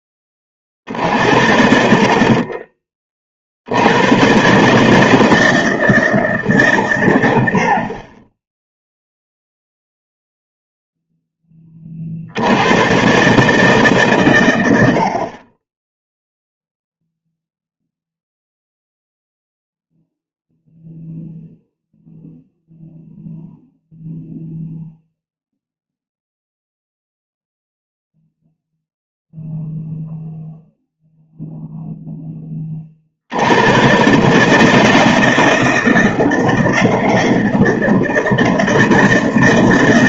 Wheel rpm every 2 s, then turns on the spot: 50, 30, 150, 120, 0, 0, 110, 80, 0, 0, 0, 0, 0, 0, 0, 0, 40, 160, 160, 160.
none